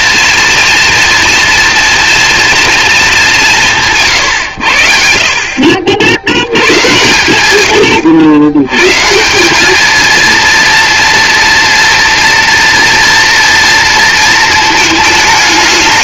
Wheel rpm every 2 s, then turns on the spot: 240, 230, 90, 100, 120, 230, 240, 210.
none